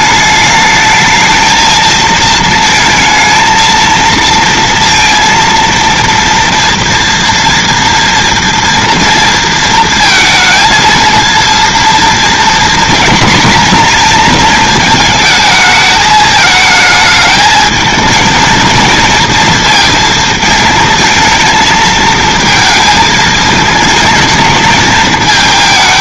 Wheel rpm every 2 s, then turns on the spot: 210, 220, 230, 230, 230, 230, 240, 220, 220, 230, 220, 220, 220.
none